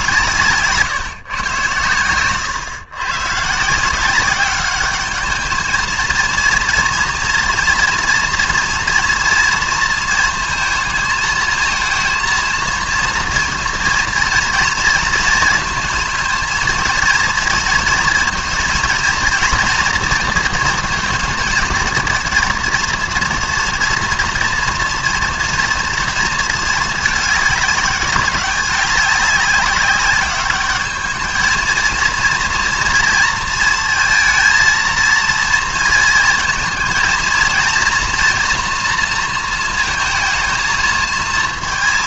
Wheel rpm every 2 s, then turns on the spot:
150, 120, 190, 230, 240, 220, 230, 230, 230, 240, 230, 220, 240, 230, 200, 200, 240, 230, 220, 230, 220.
none